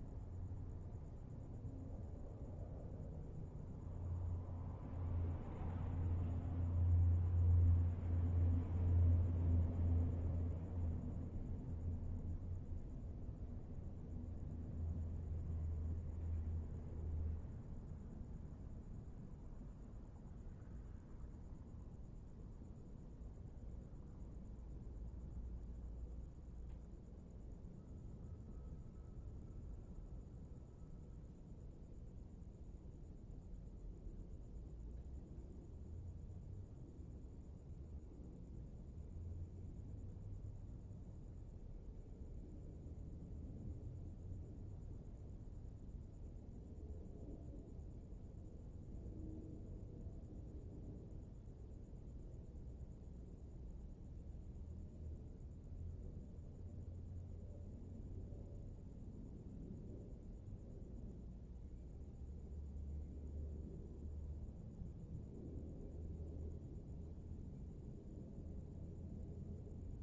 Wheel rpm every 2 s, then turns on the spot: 0, 0, 0, 0, 0, 0, 0, 0, 0, 0, 0, 0, 0, 0, 0, 0, 0, 0, 0, 0, 0, 0, 0, 0, 0, 0, 0, 0, 0, 0, 0, 0, 0, 0, 0.
none